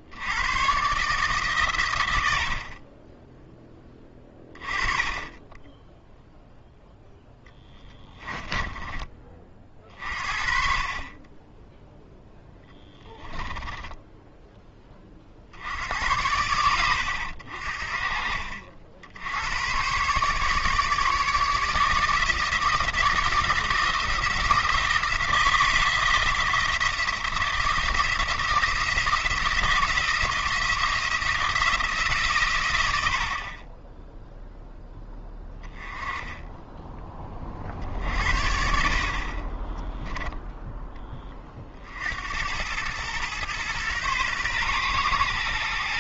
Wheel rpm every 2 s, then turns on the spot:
130, 30, 20, 0, 20, 40, 10, 20, 90, 60, 150, 160, 170, 160, 170, 170, 100, 0, 10, 50, 10, 100, 120.
8-10 12-14